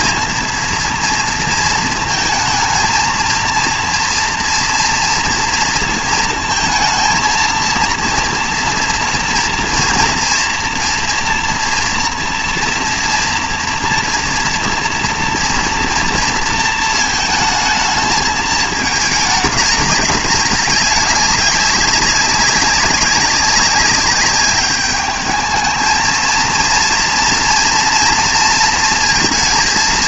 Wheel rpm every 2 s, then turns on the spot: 230, 220, 230, 230, 230, 230, 240, 230, 230, 220, 200, 200, 200, 230, 230.
none